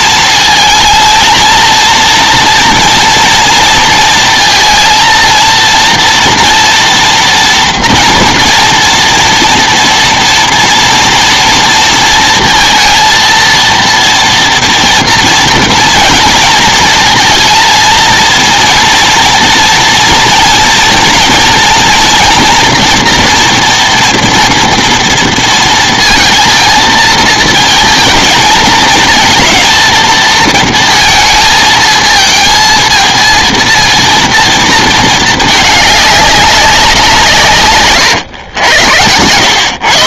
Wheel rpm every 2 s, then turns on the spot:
220, 230, 230, 230, 230, 230, 230, 230, 230, 230, 230, 240, 230, 230, 220, 230, 220, 230, 200, 120.
none